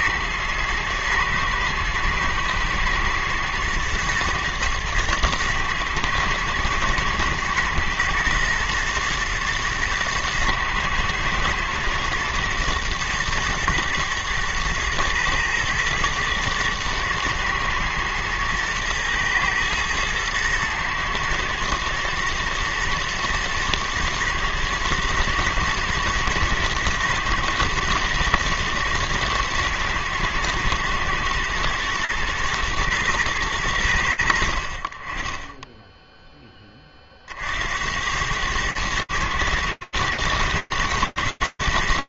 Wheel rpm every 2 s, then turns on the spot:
120, 120, 110, 110, 110, 120, 120, 120, 120, 120, 110, 120, 110, 110, 110, 110, 80, 10, 70, 110, 110.
none